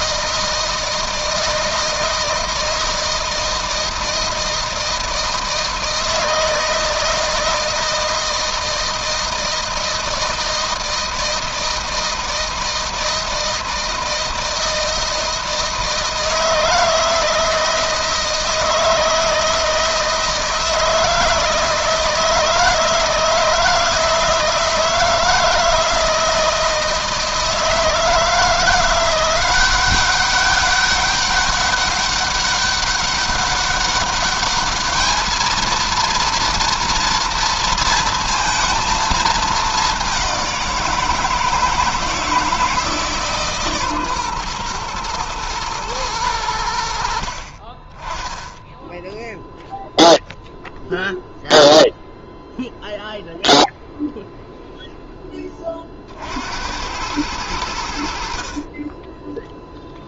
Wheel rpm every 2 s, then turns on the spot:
160, 160, 160, 160, 160, 160, 160, 160, 160, 160, 160, 160, 160, 160, 160, 190, 200, 200, 230, 230, 190, 160, 130, 90, 10, 0, 0, 0, 70, 50.
none